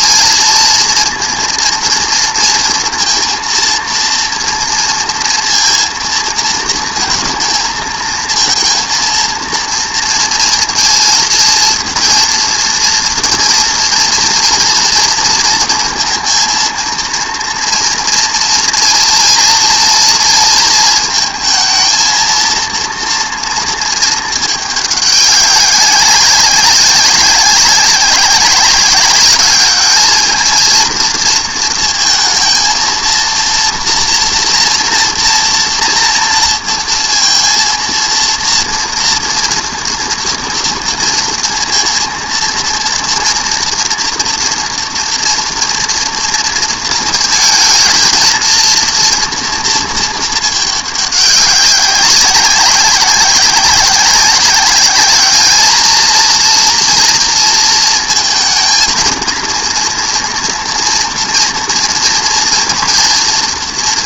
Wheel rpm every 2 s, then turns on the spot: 230, 230, 230, 230, 230, 230, 230, 230, 230, 230, 230, 230, 210, 190, 190, 230, 230, 230, 230, 230, 230, 230, 230, 230, 230, 210, 200, 200, 230, 230, 240, 230.
none